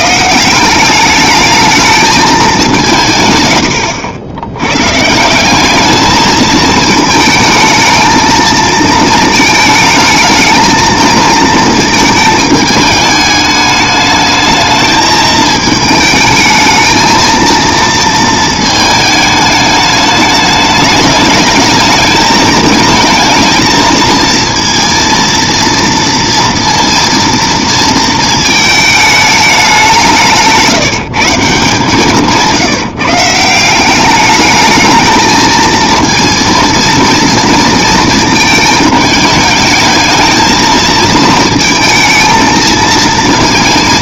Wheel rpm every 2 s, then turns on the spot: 180, 190, 110, 220, 220, 220, 210, 220, 220, 220, 210, 220, 230, 230, 220, 160, 160, 220, 230, 220, 230, 220.
none